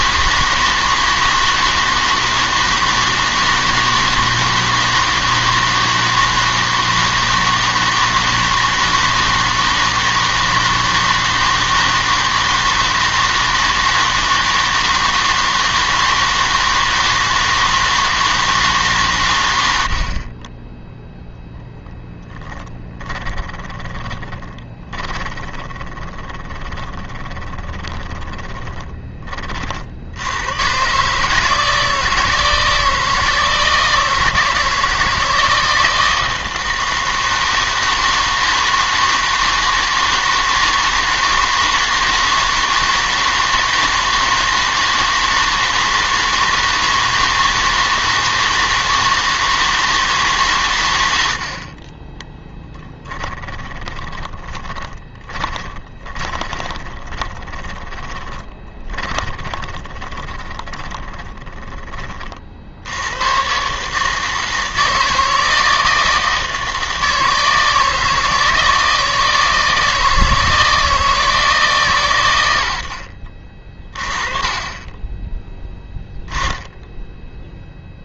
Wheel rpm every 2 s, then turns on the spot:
160, 160, 160, 160, 160, 160, 160, 160, 160, 150, 10, 30, 20, 20, 20, 120, 160, 160, 160, 160, 160, 160, 160, 160, 160, 110, 20, 20, 20, 20, 10, 50, 160, 160, 160, 160, 80, 20, 0.
22-30 52-62